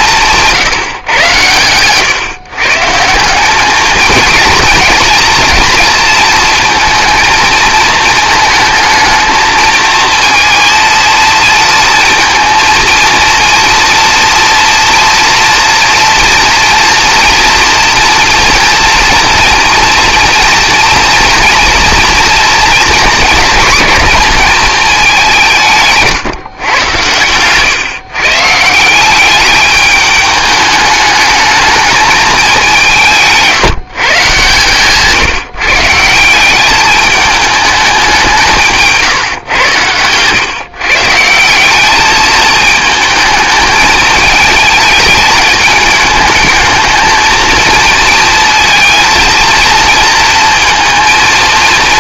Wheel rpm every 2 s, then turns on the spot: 160, 140, 230, 230, 220, 230, 230, 230, 230, 230, 230, 240, 220, 120, 170, 210, 180, 150, 200, 160, 130, 220, 220, 220, 230, 230.
34-36